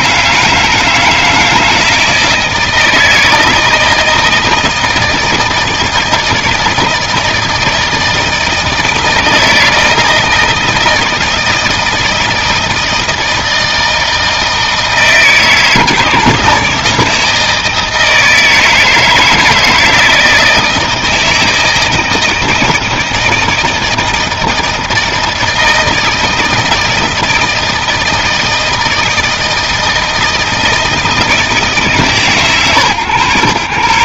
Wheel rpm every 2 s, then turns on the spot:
160, 160, 160, 160, 160, 160, 160, 160, 150, 160, 160, 160, 160, 160, 160, 160, 130.
none